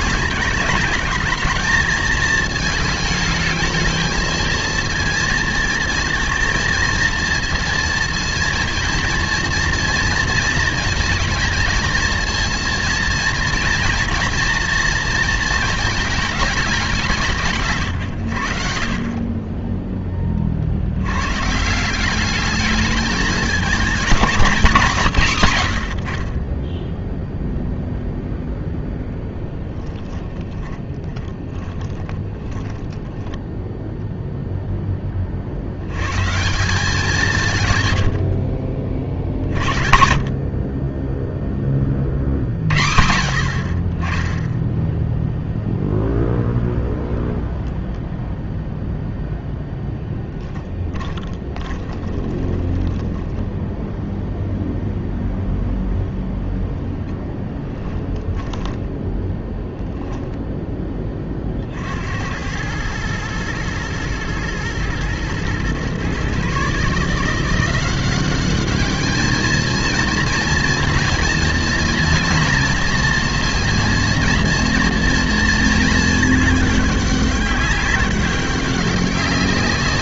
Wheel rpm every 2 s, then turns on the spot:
210, 220, 230, 230, 230, 230, 230, 230, 200, 80, 50, 210, 180, 10, 20, 20, 10, 0, 160, 60, 40, 70, 0, 0, 0, 10, 30, 0, 0, 10, 10, 100, 120, 140, 200, 220, 230, 240, 210, 190.
28-34 40-42 50-54 58-60